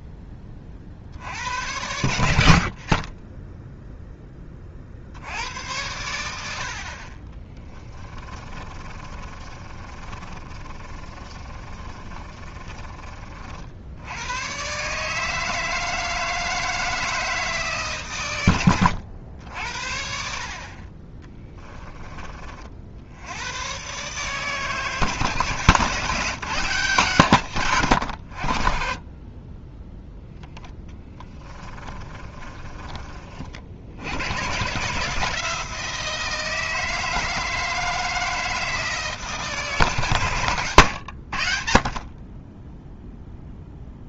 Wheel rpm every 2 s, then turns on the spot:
40, 40, 50, 50, 30, 30, 30, 130, 160, 100, 30, 60, 150, 180, 40, 10, 30, 140, 160, 160, 110, 10.
8-14 30-32